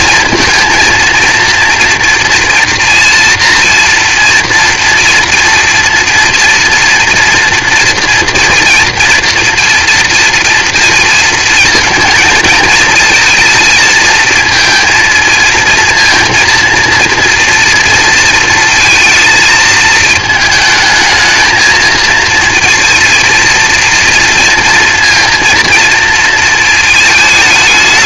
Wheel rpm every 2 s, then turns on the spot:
230, 240, 230, 230, 230, 230, 220, 230, 230, 230, 220, 220, 230, 220.
none